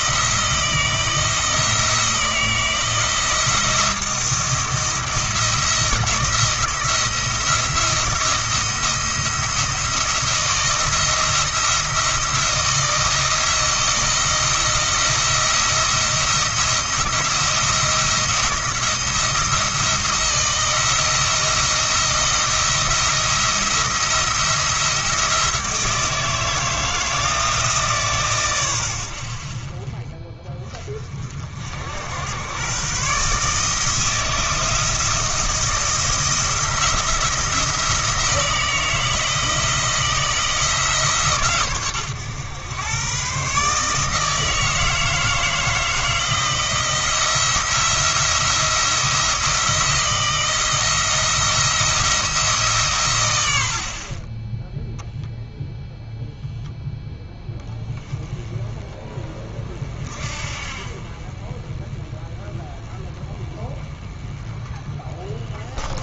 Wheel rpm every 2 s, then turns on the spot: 170, 160, 170, 170, 170, 170, 170, 170, 170, 160, 170, 170, 170, 160, 100, 20, 120, 170, 170, 160, 160, 110, 160, 170, 170, 170, 150, 10, 0, 20, 40, 20, 20.
none